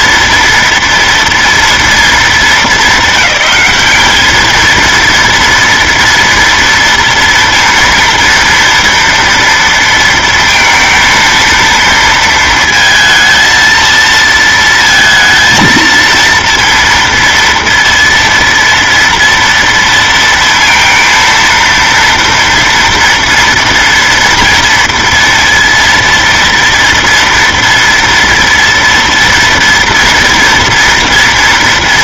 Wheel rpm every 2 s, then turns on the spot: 230, 220, 220, 230, 230, 230, 230, 230, 230, 230, 230, 230, 230, 230, 230, 230.
none